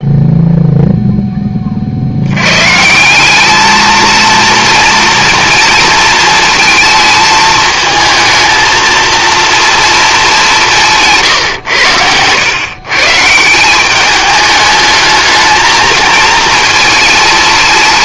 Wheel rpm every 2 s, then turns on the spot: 0, 150, 230, 220, 230, 170, 140, 210, 230.
none